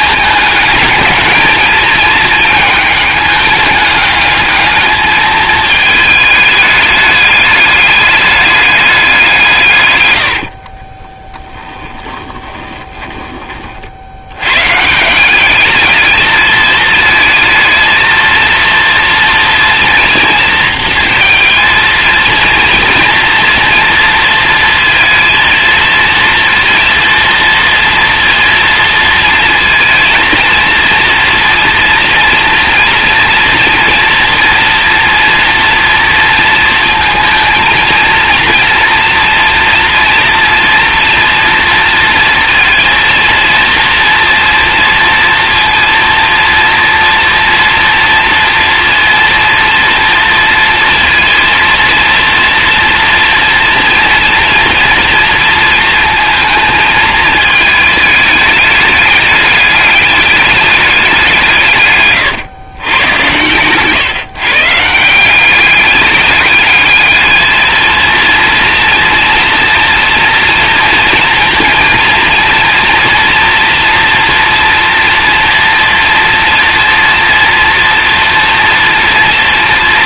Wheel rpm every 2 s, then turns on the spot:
210, 210, 210, 210, 200, 30, 10, 140, 220, 230, 230, 230, 230, 230, 230, 230, 230, 240, 230, 230, 240, 230, 230, 230, 230, 230, 230, 230, 220, 210, 200, 120, 160, 220, 230, 240, 240, 230, 230, 230.
10-14